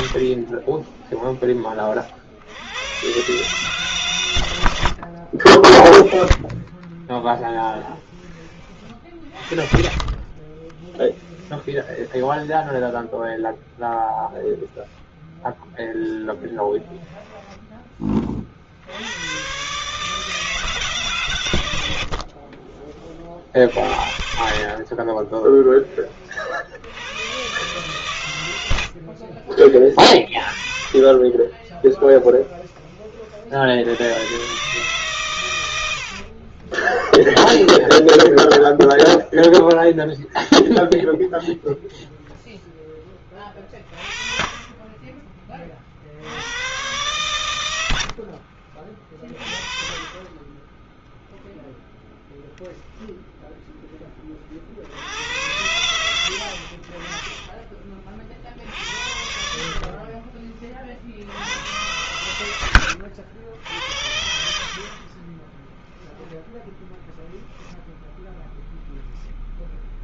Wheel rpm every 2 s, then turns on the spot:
50, 70, 110, 20, 20, 30, 10, 0, 0, 50, 150, 40, 60, 70, 90, 40, 30, 120, 40, 10, 0, 10, 20, 90, 60, 30, 20, 40, 70, 40, 50, 100, 70, 10, 0.
0-2 10-14 22-26 30-34 36-38 48-50 52-54 62-64 66-68